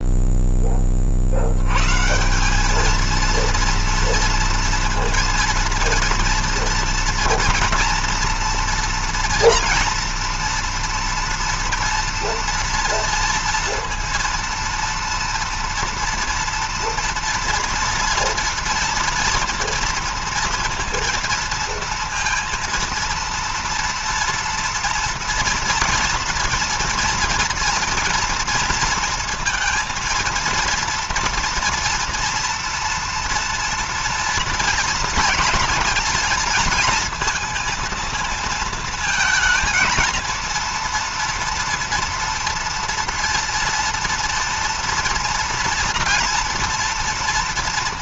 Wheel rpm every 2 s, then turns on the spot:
20, 210, 230, 230, 230, 230, 230, 230, 230, 240, 230, 230, 230, 230, 230, 230, 240, 240, 230, 230, 230, 230, 230, 240.
none